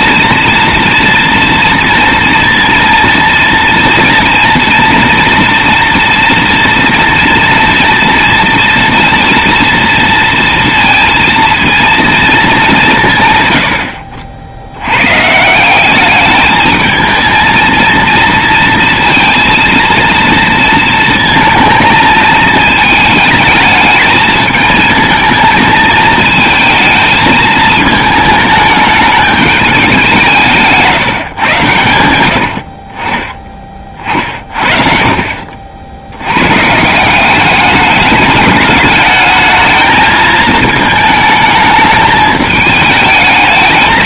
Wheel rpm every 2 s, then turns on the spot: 230, 230, 230, 230, 230, 230, 200, 70, 220, 230, 230, 220, 220, 220, 210, 170, 70, 50, 140, 210, 220, 210.
none